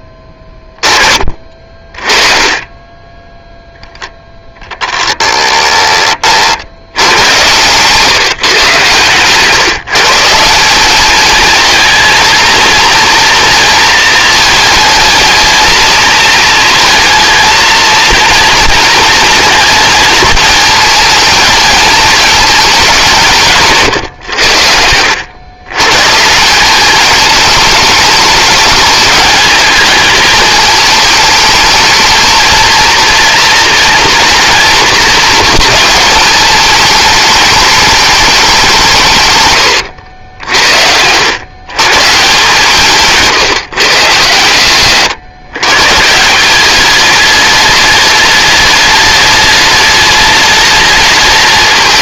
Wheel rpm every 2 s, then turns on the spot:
20, 10, 10, 80, 130, 200, 230, 220, 230, 230, 230, 200, 80, 200, 210, 210, 230, 240, 210, 160, 70, 160, 130, 200, 210, 210.
none